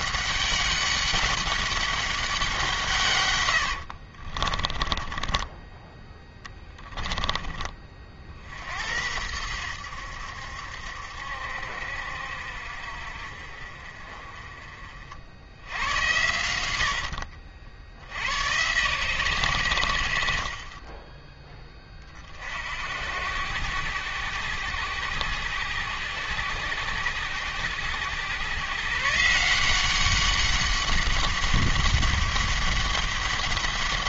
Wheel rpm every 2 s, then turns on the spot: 200, 160, 20, 10, 70, 70, 60, 40, 80, 120, 40, 60, 90, 90, 130, 200, 200.
4-6